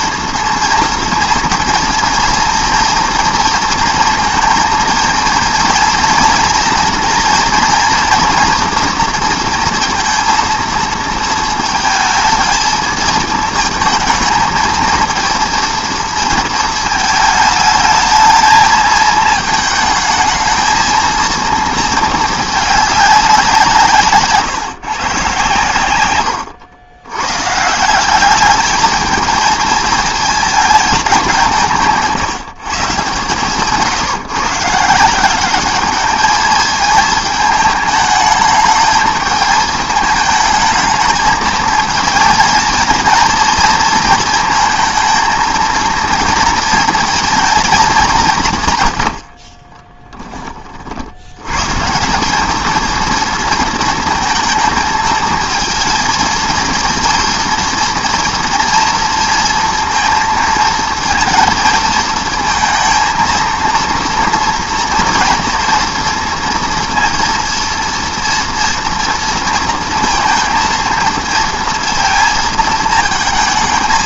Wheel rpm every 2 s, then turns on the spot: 230, 230, 230, 230, 240, 230, 220, 220, 220, 220, 220, 210, 150, 90, 210, 220, 140, 150, 220, 220, 220, 220, 230, 230, 130, 40, 220, 220, 230, 230, 230, 230, 230, 230, 230, 230, 220.
none